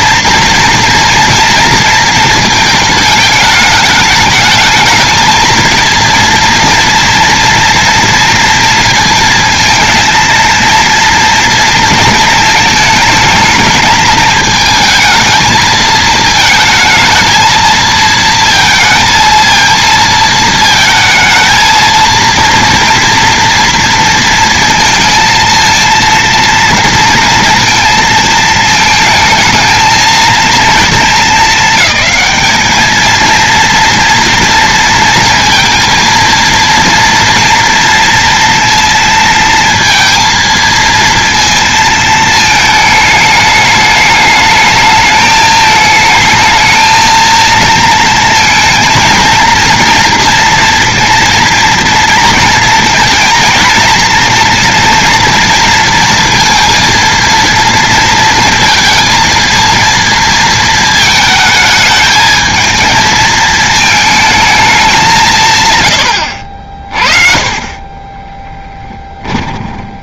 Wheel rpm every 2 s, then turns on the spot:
230, 220, 220, 230, 230, 230, 220, 220, 220, 230, 220, 230, 230, 230, 220, 220, 220, 230, 230, 230, 230, 220, 210, 220, 230, 230, 230, 230, 230, 230, 220, 220, 200, 40, 10.
68-70